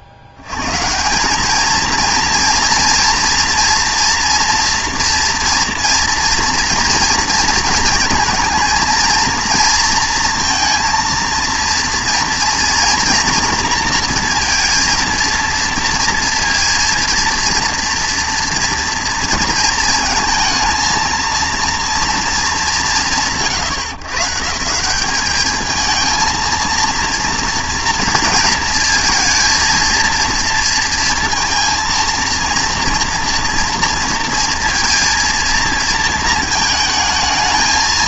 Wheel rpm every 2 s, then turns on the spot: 80, 230, 240, 230, 230, 230, 240, 230, 230, 240, 230, 220, 170, 230, 230, 230, 230, 230, 220.
none